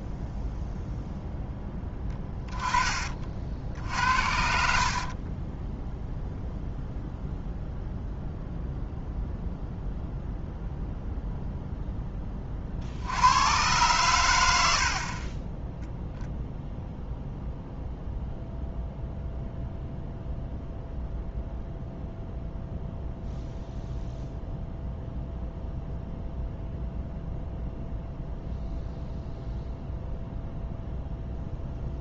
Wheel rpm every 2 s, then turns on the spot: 0, 20, 60, 0, 0, 0, 30, 50, 0, 0, 0, 0, 0, 0, 0, 0.
4-6